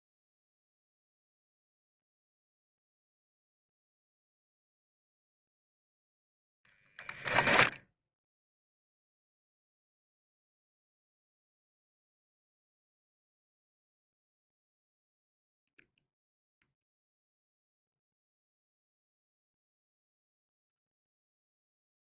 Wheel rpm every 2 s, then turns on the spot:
0, 0, 0, 10, 0, 0, 0, 0, 0, 0, 0.
6-8